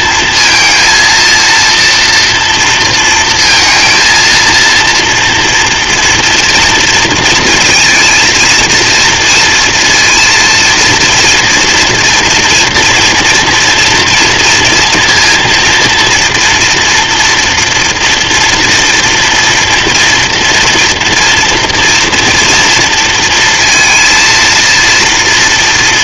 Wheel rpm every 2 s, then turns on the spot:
230, 240, 230, 230, 230, 230, 230, 230, 230, 230, 230, 230, 230.
none